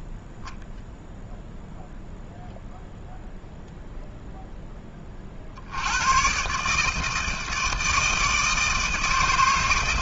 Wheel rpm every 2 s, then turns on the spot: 0, 0, 10, 140, 160.
none